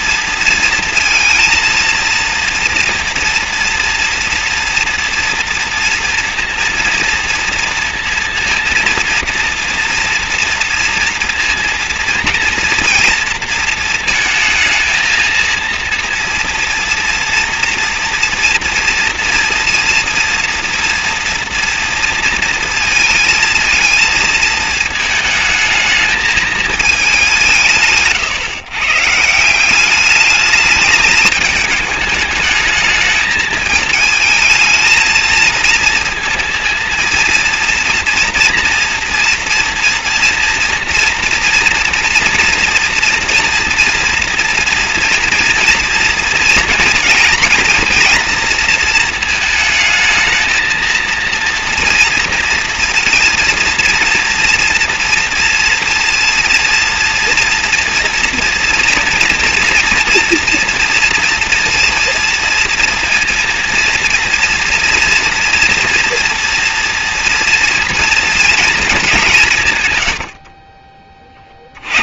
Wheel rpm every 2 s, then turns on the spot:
230, 230, 240, 240, 230, 230, 230, 220, 230, 230, 230, 230, 220, 220, 120, 210, 210, 220, 230, 230, 230, 230, 230, 230, 230, 220, 230, 230, 230, 230, 230, 230, 230, 230, 230, 40.
70-72